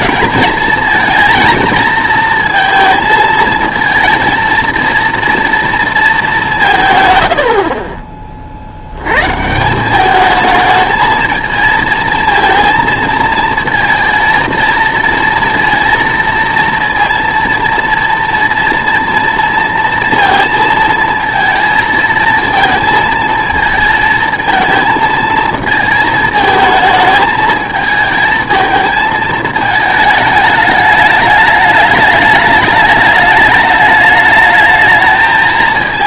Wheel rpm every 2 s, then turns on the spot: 230, 230, 230, 160, 60, 220, 230, 230, 230, 230, 230, 220, 220, 220, 220, 210, 210, 220.
none